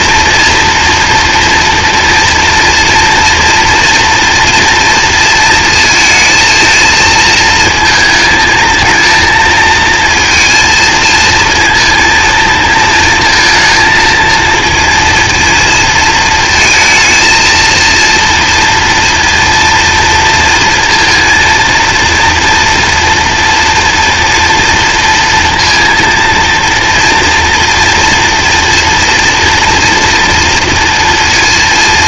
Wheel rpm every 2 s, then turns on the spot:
230, 230, 230, 220, 220, 230, 230, 230, 230, 230, 230, 240, 230, 230, 230, 240.
none